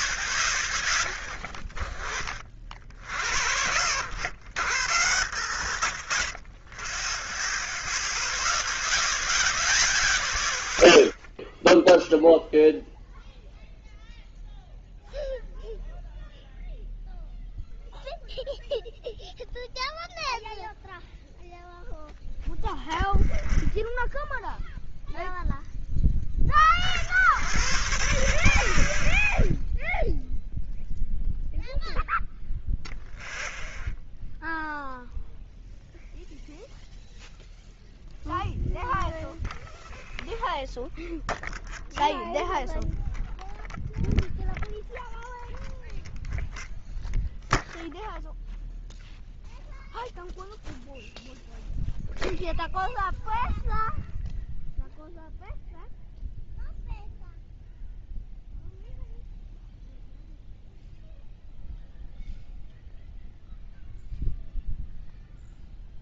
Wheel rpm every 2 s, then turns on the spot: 20, 40, 80, 30, 0, 0, 0, 0, 0, 0, 0, 0, 0, 50, 60, 0, 0, 0, 0, 0, 0, 0, 0, 0, 0, 0, 0, 0, 0, 0, 0, 0, 0.
none